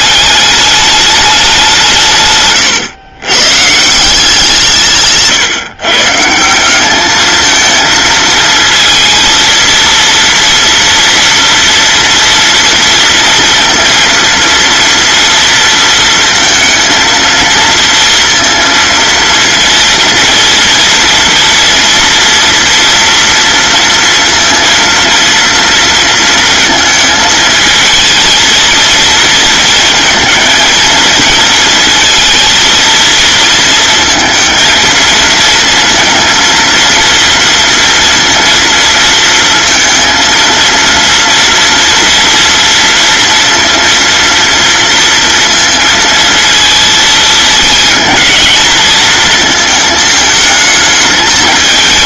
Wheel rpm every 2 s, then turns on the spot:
210, 120, 160, 190, 230, 230, 230, 230, 230, 230, 230, 230, 230, 220, 230, 220, 220, 220, 230, 230, 230, 230, 230, 230, 230, 210.
none